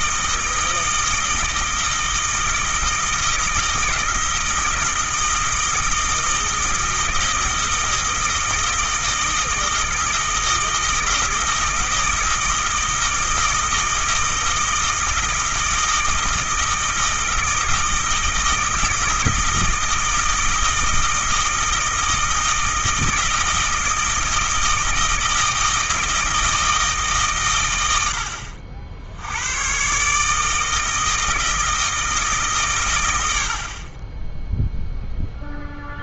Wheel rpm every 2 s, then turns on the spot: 160, 160, 160, 160, 160, 160, 160, 160, 160, 160, 160, 160, 160, 150, 70, 160, 120, 0.
none